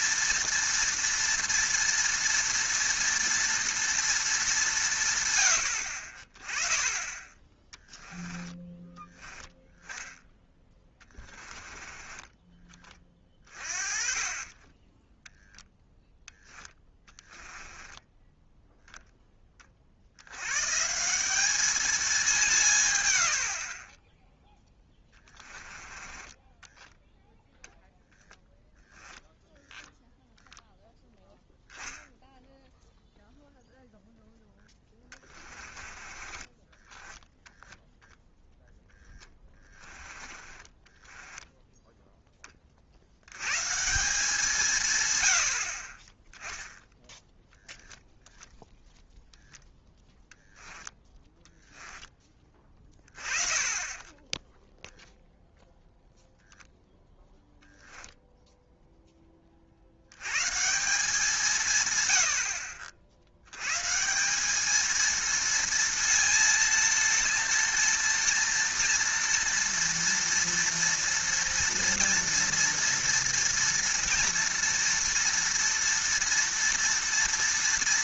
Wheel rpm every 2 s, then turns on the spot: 230, 230, 190, 20, 10, 10, 20, 30, 10, 0, 120, 170, 0, 10, 20, 0, 0, 10, 20, 0, 20, 20, 160, 10, 0, 10, 20, 10, 0, 0, 150, 80, 200, 230, 230, 230, 230, 230, 230.
10-12 14-18 26-28 36-38 40-42 50-52 54-56